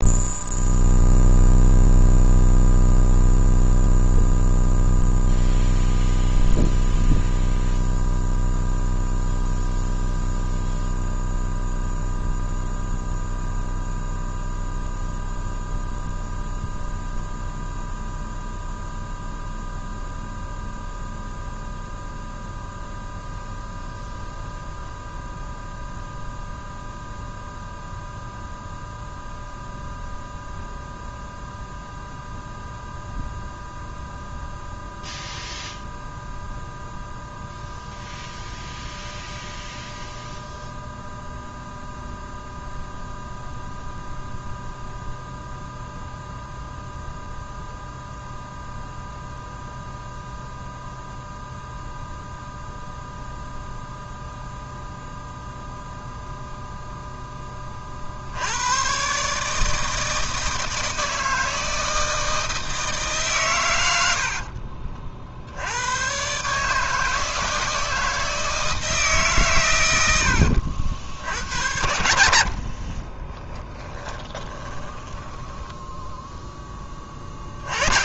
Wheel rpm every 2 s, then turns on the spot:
0, 0, 0, 0, 0, 0, 0, 0, 0, 0, 0, 0, 0, 0, 0, 0, 0, 0, 0, 0, 0, 0, 0, 0, 0, 0, 0, 0, 0, 100, 160, 160, 50, 150, 160, 70, 50, 20, 10.
64-66 74-76